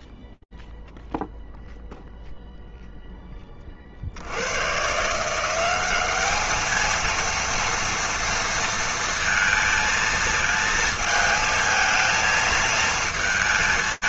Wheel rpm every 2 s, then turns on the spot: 0, 0, 60, 210, 230, 230, 220.
none